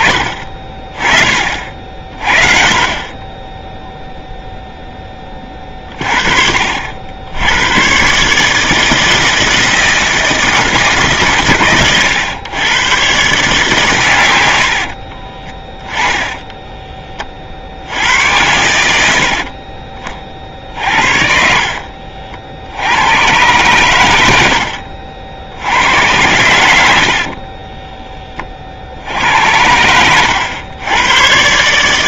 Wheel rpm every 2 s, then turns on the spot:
30, 30, 10, 70, 160, 140, 120, 100, 10, 70, 60, 80, 70, 80, 60, 100.
14-16 24-26